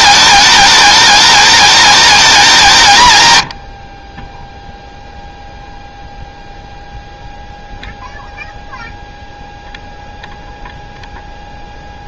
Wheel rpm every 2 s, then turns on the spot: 210, 190, 0, 0, 0, 0.
none